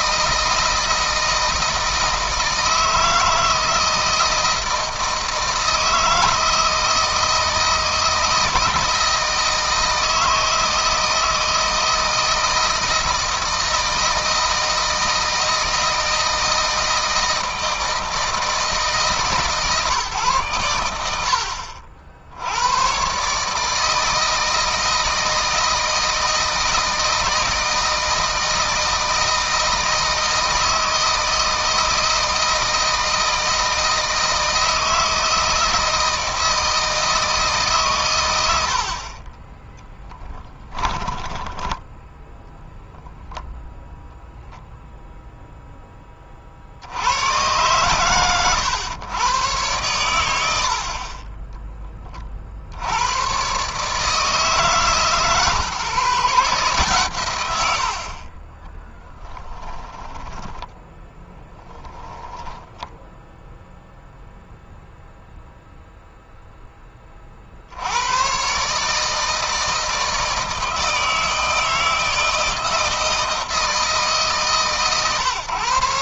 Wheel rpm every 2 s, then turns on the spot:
160, 160, 160, 160, 160, 160, 160, 160, 160, 160, 100, 110, 160, 160, 160, 160, 160, 160, 160, 60, 10, 0, 0, 70, 120, 70, 70, 150, 140, 20, 20, 20, 0, 20, 140, 160, 160, 120.
40-42 58-62